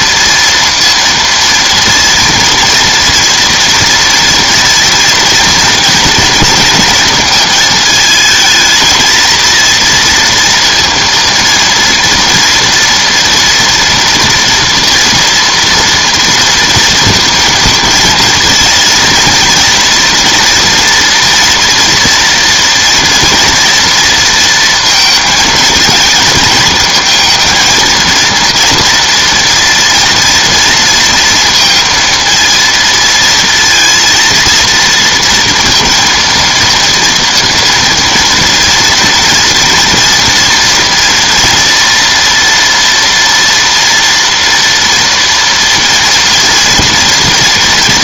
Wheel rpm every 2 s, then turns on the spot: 230, 230, 230, 230, 220, 230, 230, 230, 230, 230, 240, 230, 230, 220, 240, 230, 230, 230, 230, 230, 230, 230, 230, 230.
none